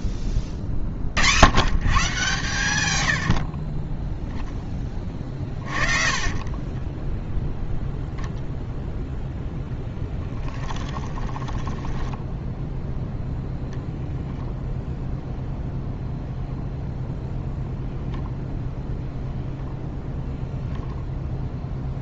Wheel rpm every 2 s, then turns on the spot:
90, 20, 100, 20, 0, 10, 0, 0, 0, 0, 0.
6-8 10-12